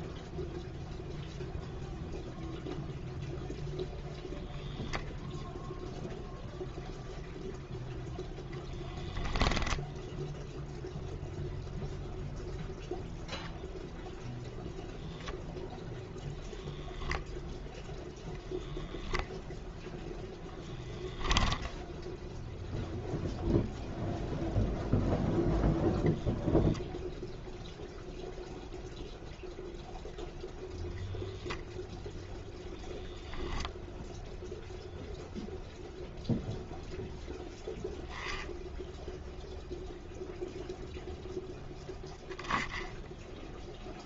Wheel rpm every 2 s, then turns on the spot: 0, 0, 0, 0, 10, 0, 0, 0, 0, 0, 10, 0, 0, 0, 0, 0, 0, 0, 0, 0, 0, 10.
8-10